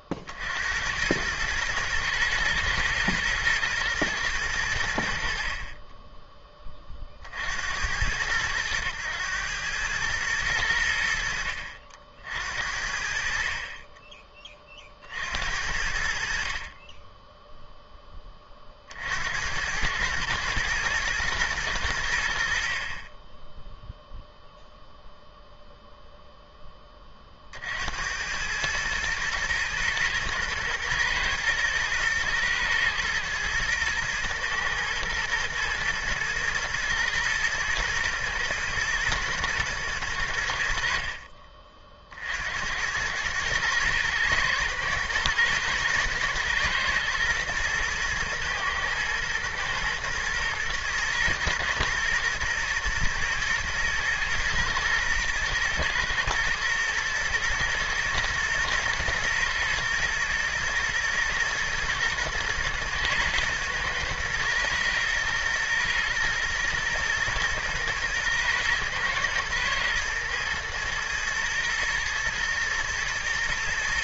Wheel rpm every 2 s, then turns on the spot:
80, 110, 80, 20, 100, 90, 60, 40, 30, 50, 110, 50, 0, 10, 110, 120, 110, 110, 120, 110, 60, 90, 110, 120, 120, 120, 110, 110, 120, 120, 110, 120, 110, 120, 120, 110, 110.
none